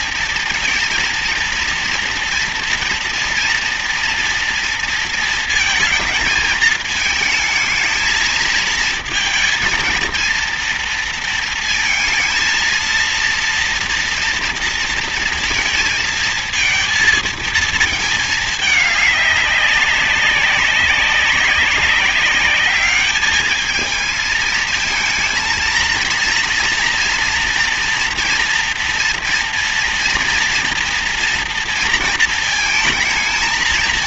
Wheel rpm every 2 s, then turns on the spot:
230, 230, 230, 220, 220, 230, 230, 230, 220, 210, 190, 210, 220, 240, 230, 230, 220.
none